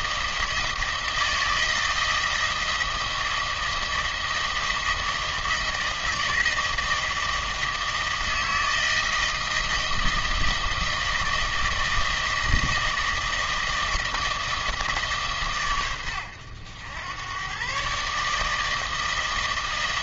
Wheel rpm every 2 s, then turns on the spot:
160, 160, 160, 160, 160, 160, 160, 160, 90, 160.
none